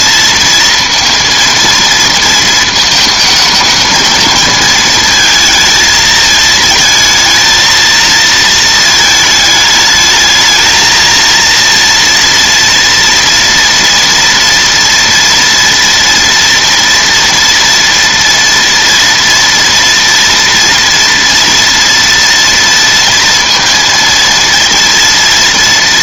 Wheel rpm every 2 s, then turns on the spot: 230, 220, 220, 220, 220, 220, 230, 230, 230, 240, 230, 230, 230.
none